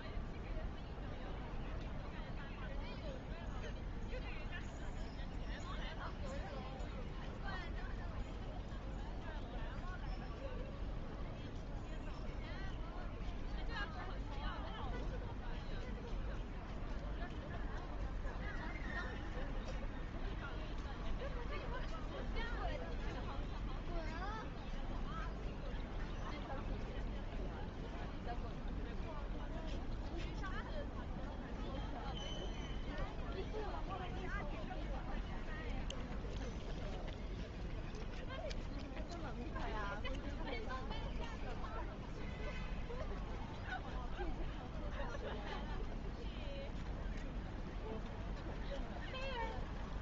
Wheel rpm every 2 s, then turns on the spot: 0, 0, 0, 0, 0, 0, 0, 0, 0, 0, 0, 0, 0, 0, 0, 0, 0, 0, 0, 0, 0, 0, 0, 0, 0.
none